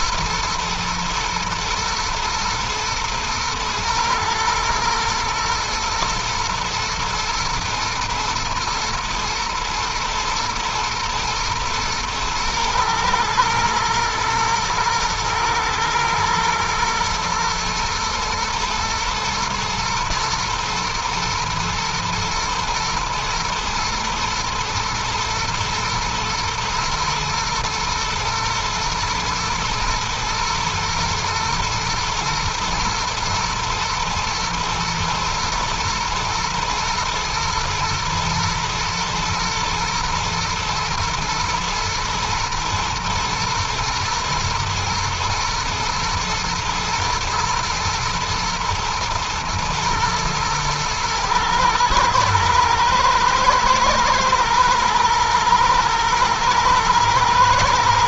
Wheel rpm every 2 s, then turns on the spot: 110, 110, 110, 120, 110, 110, 110, 120, 120, 120, 110, 110, 110, 120, 110, 120, 120, 110, 110, 110, 110, 110, 120, 120, 120, 110, 110, 110, 120.
none